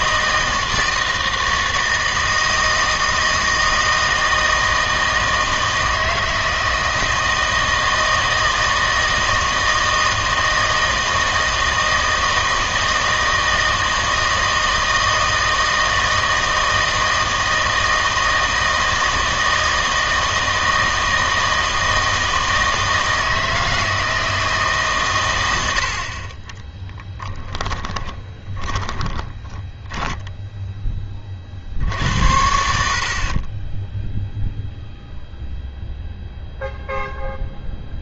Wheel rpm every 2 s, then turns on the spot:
160, 160, 160, 160, 160, 160, 160, 160, 160, 160, 160, 160, 150, 20, 20, 0, 70, 0, 0.
26-30